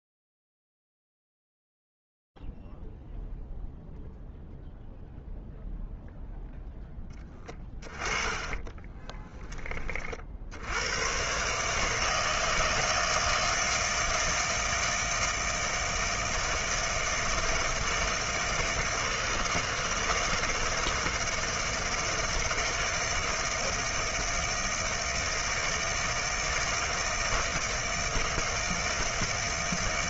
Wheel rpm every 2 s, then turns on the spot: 0, 0, 0, 0, 20, 50, 160, 160, 160, 160, 160, 160, 160, 160, 160.
8-10